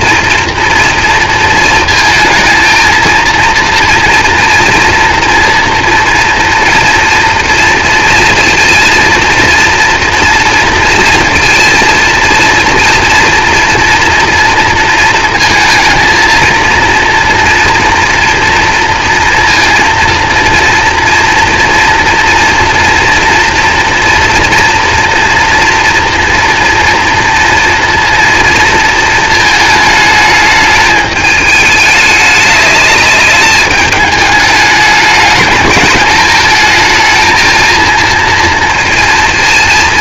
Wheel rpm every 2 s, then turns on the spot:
240, 220, 230, 230, 230, 230, 230, 230, 230, 230, 230, 230, 230, 230, 230, 220, 210, 210, 220, 230.
none